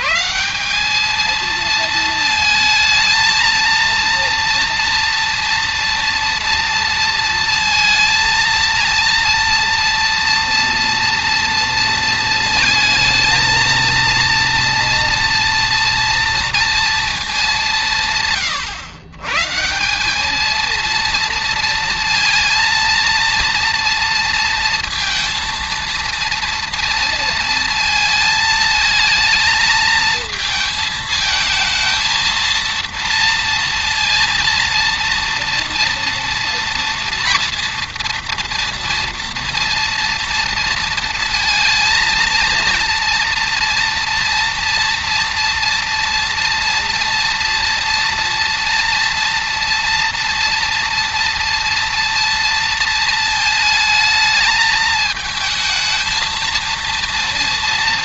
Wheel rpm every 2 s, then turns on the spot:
200, 220, 230, 230, 230, 240, 220, 230, 230, 130, 230, 230, 230, 230, 220, 220, 230, 230, 240, 230, 230, 230, 230, 240, 230, 230, 230, 220, 230.
none